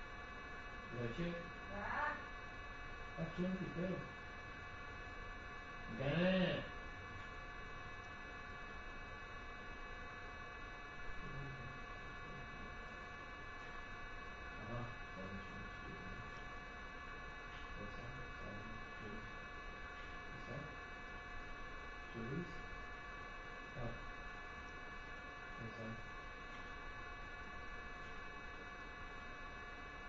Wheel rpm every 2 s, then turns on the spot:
0, 0, 0, 0, 0, 0, 0, 0, 0, 0, 0, 0, 0, 0, 0.
none